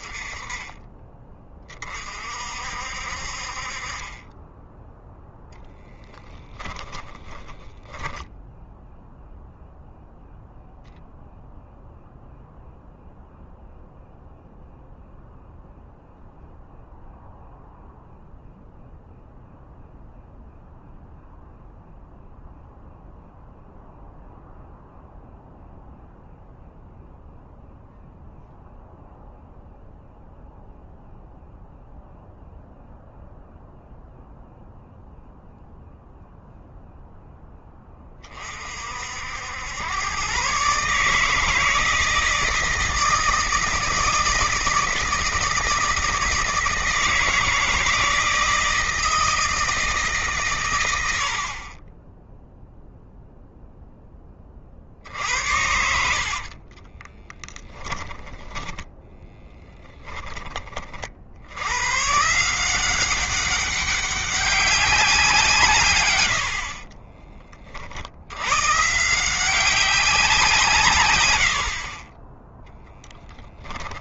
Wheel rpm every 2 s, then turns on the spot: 20, 50, 10, 20, 0, 0, 0, 0, 0, 0, 0, 0, 0, 0, 0, 0, 0, 0, 0, 60, 150, 160, 160, 160, 160, 90, 0, 60, 20, 10, 40, 180, 180, 30, 140, 120, 10.
6-8 56-60 66-68 72-74